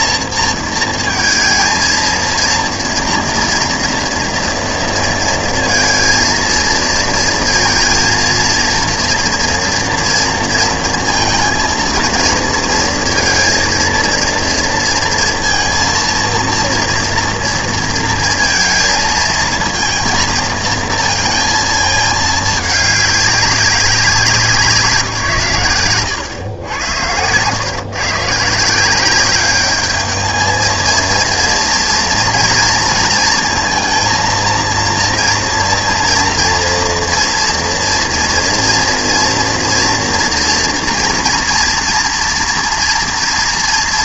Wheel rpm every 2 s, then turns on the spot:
230, 230, 230, 230, 230, 230, 230, 230, 230, 230, 220, 210, 180, 100, 150, 220, 230, 230, 230, 230, 230, 230.
none